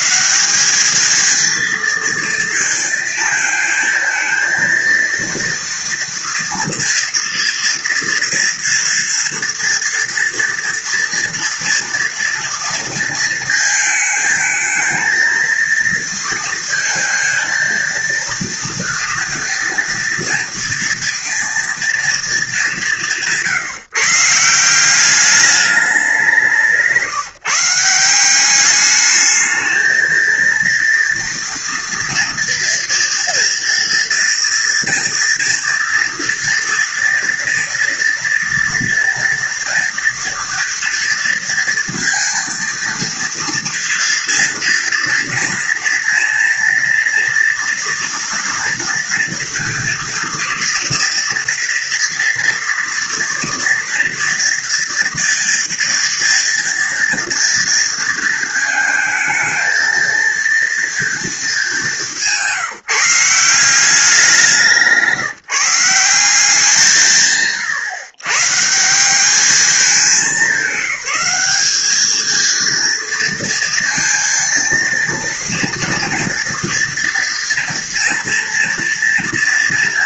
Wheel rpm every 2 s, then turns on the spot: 220, 230, 230, 230, 230, 230, 220, 230, 230, 230, 240, 170, 200, 160, 210, 230, 230, 230, 230, 230, 230, 230, 230, 230, 230, 230, 230, 240, 230, 220, 220, 170, 160, 140, 190, 190, 230, 230, 230, 230.
none